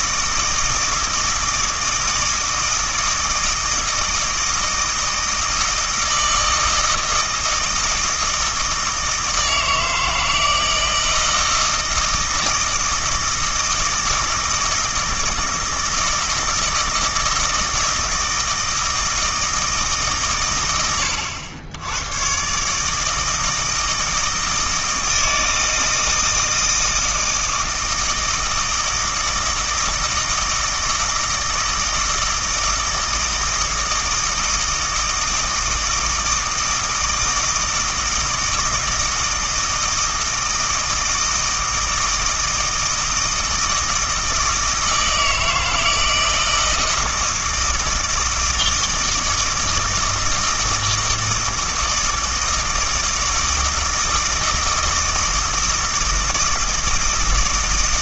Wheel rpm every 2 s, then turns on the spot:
160, 160, 160, 160, 160, 160, 160, 160, 160, 160, 100, 140, 160, 160, 160, 160, 160, 160, 160, 160, 160, 160, 160, 160, 160, 160, 160, 160, 160.
none